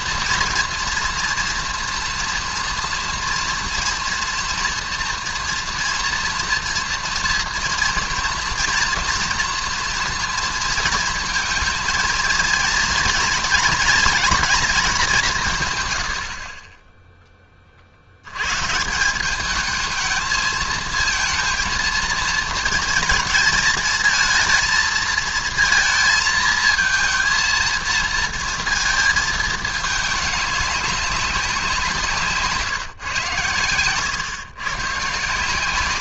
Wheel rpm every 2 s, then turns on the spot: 230, 230, 230, 230, 240, 230, 230, 220, 20, 160, 220, 220, 220, 220, 230, 200, 150, 120.
none